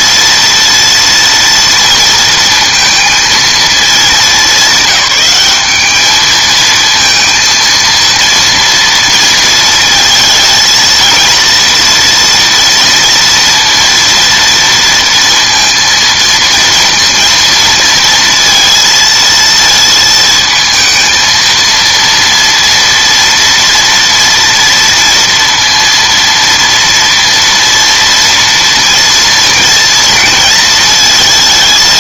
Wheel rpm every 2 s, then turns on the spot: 230, 230, 190, 220, 230, 230, 230, 230, 230, 230, 220, 230, 230, 230, 230, 230.
none